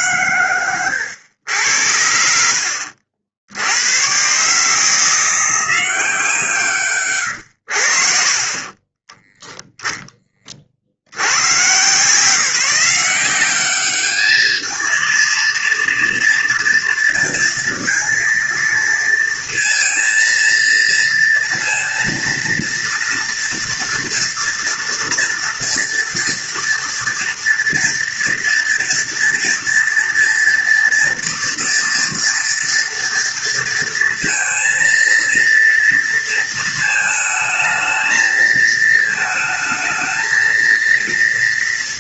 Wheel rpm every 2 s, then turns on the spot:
110, 70, 150, 150, 20, 50, 180, 220, 230, 230, 230, 230, 240, 230, 230, 230, 230, 230, 230, 220, 230.
none